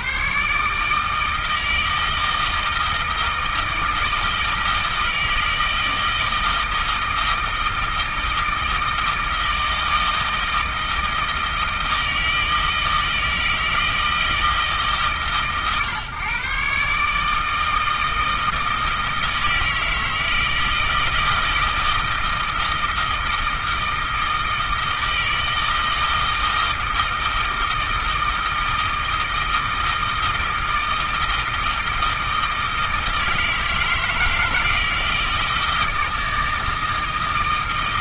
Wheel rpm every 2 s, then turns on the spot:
150, 160, 160, 160, 160, 160, 160, 160, 140, 160, 160, 160, 160, 160, 160, 160, 160, 160, 160.
none